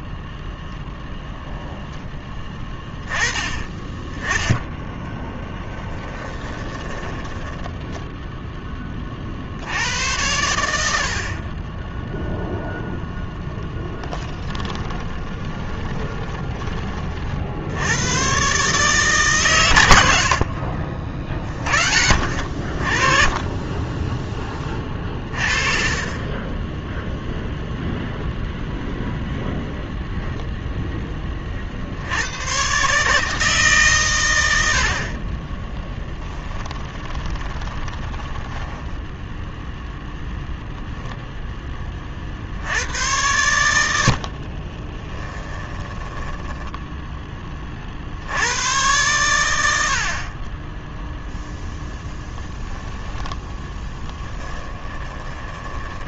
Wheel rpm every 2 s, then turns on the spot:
0, 10, 10, 20, 20, 70, 0, 20, 20, 140, 40, 50, 30, 10, 0, 10, 140, 60, 20, 10, 0, 90, 30, 10, 100, 10, 10, 20.
6-8 14-16 20-22 24-28 36-40 44-48 54-56